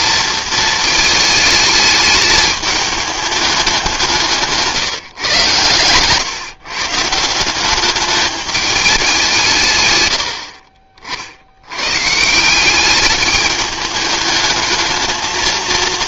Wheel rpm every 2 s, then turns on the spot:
220, 210, 160, 150, 210, 50, 190, 220.
4-6